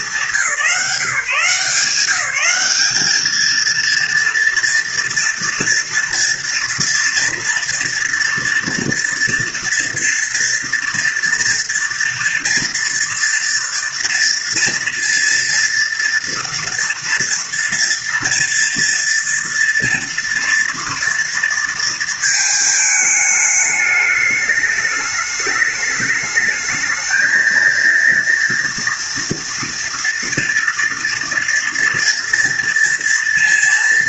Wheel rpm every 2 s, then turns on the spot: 170, 220, 230, 230, 240, 230, 230, 230, 230, 230, 230, 220, 210, 220, 230, 230, 230.
none